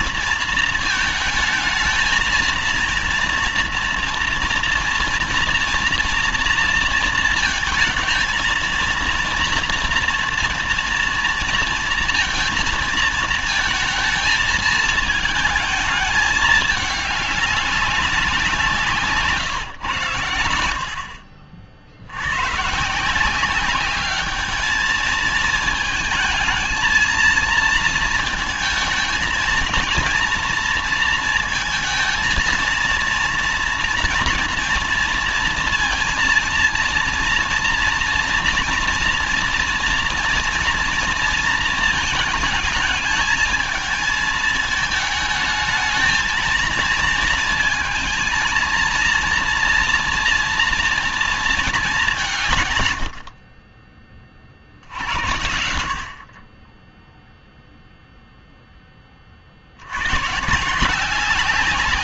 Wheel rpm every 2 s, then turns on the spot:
220, 230, 240, 230, 230, 230, 230, 220, 210, 170, 80, 130, 220, 220, 230, 240, 230, 230, 230, 230, 230, 210, 220, 230, 230, 230, 120, 60, 20, 10, 150.
20-22